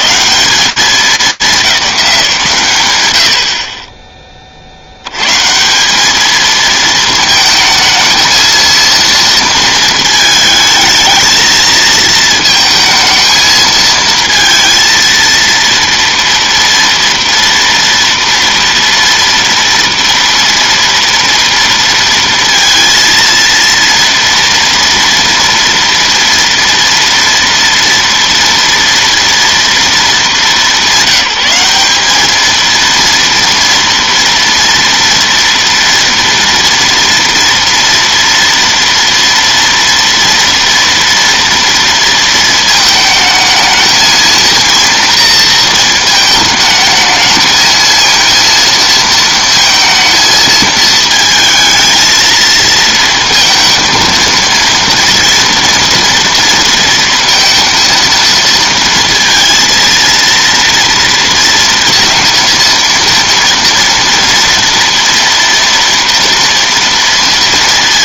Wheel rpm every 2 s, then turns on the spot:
200, 120, 90, 220, 230, 220, 220, 230, 230, 230, 230, 230, 230, 230, 230, 190, 230, 230, 230, 230, 230, 220, 230, 220, 230, 220, 230, 230, 230, 230, 230, 230, 240, 230.
none